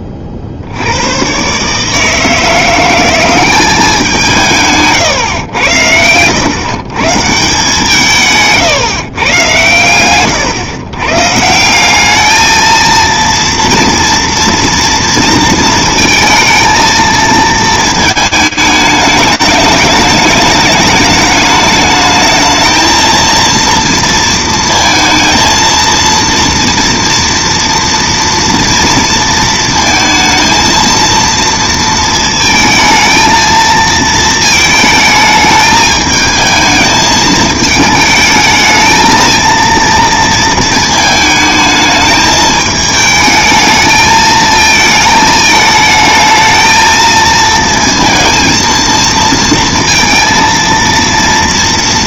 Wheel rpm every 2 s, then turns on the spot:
20, 150, 190, 90, 160, 120, 190, 230, 230, 220, 210, 210, 230, 230, 230, 230, 230, 230, 220, 220, 230, 220, 220, 220, 230, 230.
none